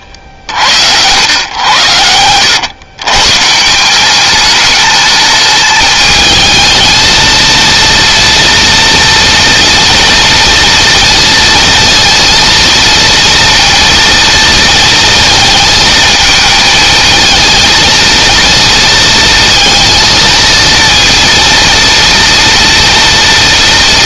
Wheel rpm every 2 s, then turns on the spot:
80, 110, 210, 220, 230, 230, 230, 230, 220, 230, 230, 230.
none